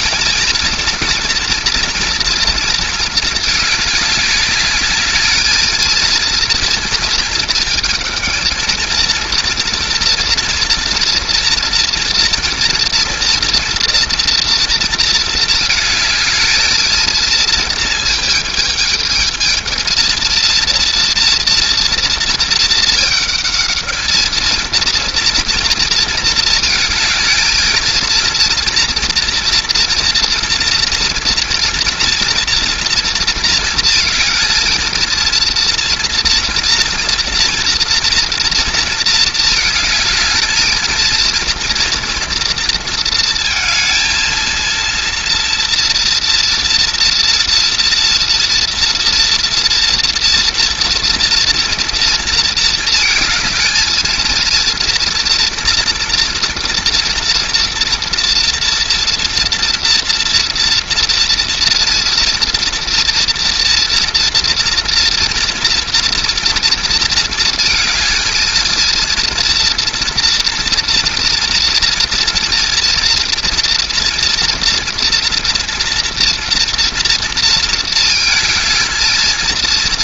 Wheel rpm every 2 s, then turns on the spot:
230, 220, 210, 230, 220, 230, 240, 230, 220, 220, 230, 220, 220, 220, 240, 230, 230, 220, 230, 230, 220, 230, 230, 230, 230, 240, 230, 230, 230, 230, 230, 230, 230, 230, 230, 230, 230, 230, 230, 220.
none